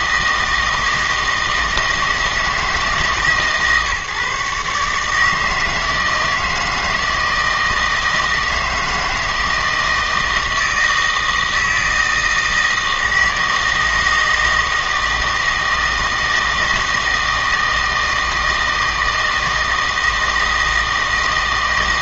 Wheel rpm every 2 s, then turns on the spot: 160, 160, 140, 160, 160, 160, 160, 160, 160, 160, 160.
none